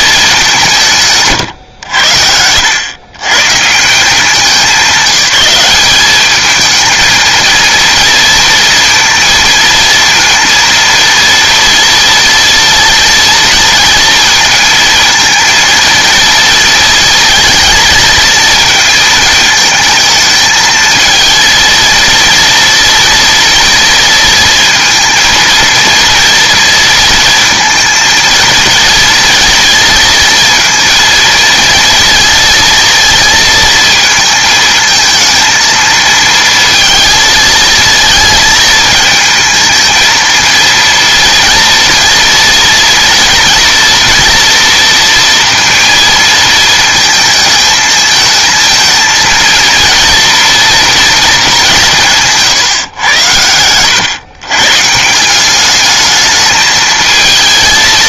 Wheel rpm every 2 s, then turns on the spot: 160, 100, 190, 220, 230, 230, 230, 230, 230, 220, 220, 230, 230, 230, 230, 230, 230, 220, 230, 230, 230, 230, 230, 220, 220, 230, 130, 150, 220.
none